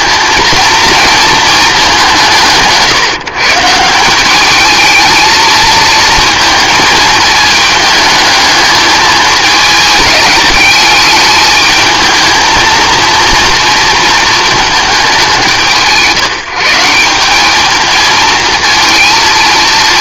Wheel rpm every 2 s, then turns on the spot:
230, 150, 220, 220, 210, 210, 230, 210, 170, 230.
none